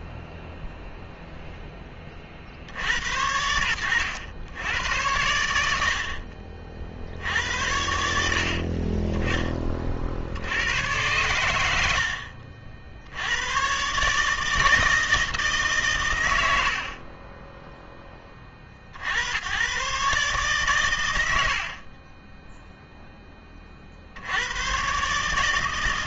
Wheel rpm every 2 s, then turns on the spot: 0, 80, 90, 50, 50, 90, 50, 160, 90, 30, 120, 0, 110.
none